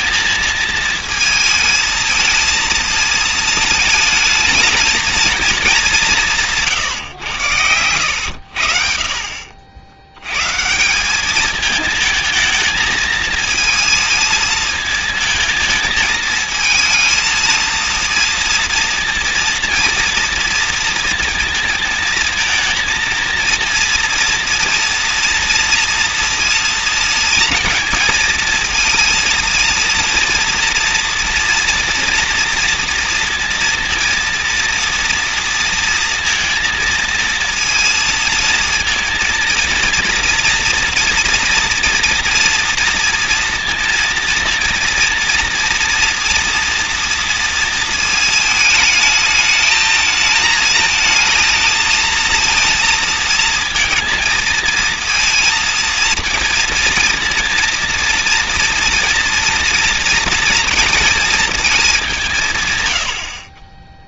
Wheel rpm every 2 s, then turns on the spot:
220, 220, 220, 160, 60, 140, 220, 220, 230, 230, 230, 230, 230, 230, 230, 230, 230, 230, 230, 230, 230, 230, 230, 230, 220, 220, 230, 220, 230, 230, 230, 140.
6-8